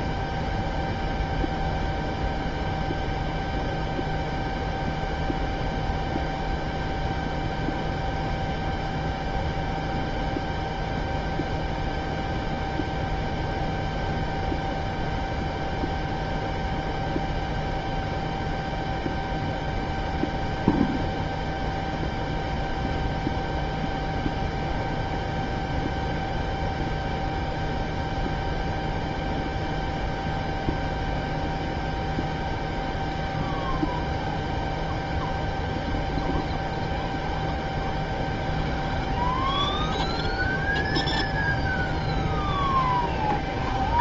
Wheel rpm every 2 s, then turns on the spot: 0, 0, 0, 0, 0, 0, 0, 0, 0, 0, 0, 0, 0, 0, 0, 0, 0, 0, 0, 0, 0, 0.
none